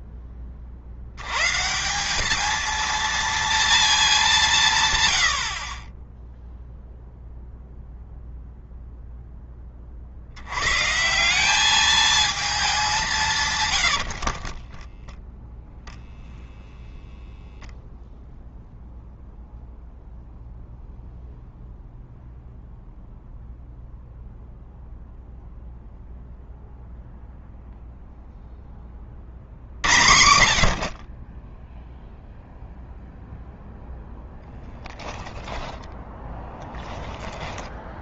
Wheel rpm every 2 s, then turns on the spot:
50, 220, 150, 0, 0, 120, 200, 20, 0, 0, 0, 0, 0, 0, 20, 60, 0, 10, 10.
14-16